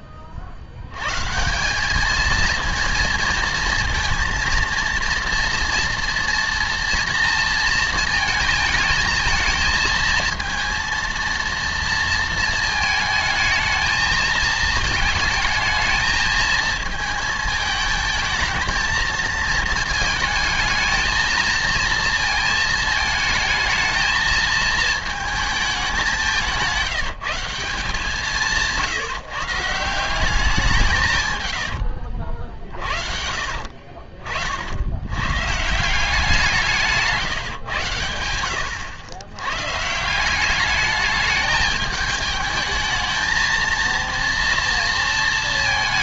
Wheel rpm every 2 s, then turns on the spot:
60, 230, 230, 230, 220, 230, 230, 220, 220, 220, 220, 220, 220, 190, 160, 190, 50, 60, 170, 90, 190, 210, 230.
32-34